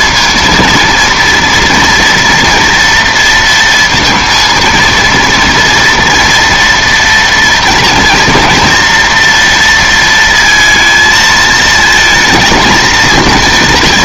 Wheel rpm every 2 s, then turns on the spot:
230, 230, 230, 230, 230, 230, 220.
none